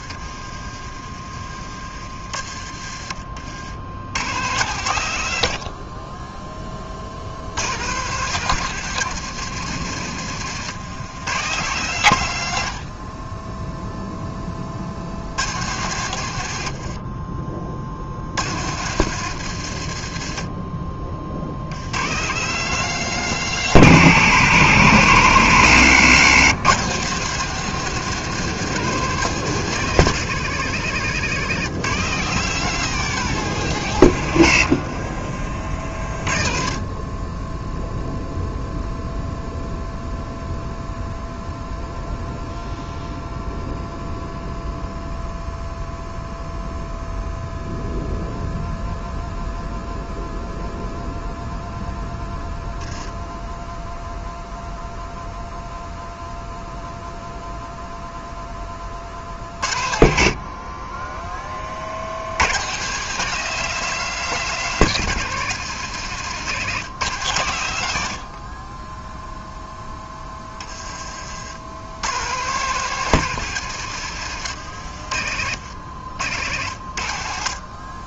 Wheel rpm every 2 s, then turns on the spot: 30, 50, 80, 70, 150, 130, 30, 80, 50, 120, 40, 150, 120, 140, 160, 140, 160, 60, 20, 0, 0, 0, 0, 0, 0, 0, 0, 0, 0, 40, 20, 150, 150, 130, 10, 40, 150, 70, 60.
16-18 34-36 74-76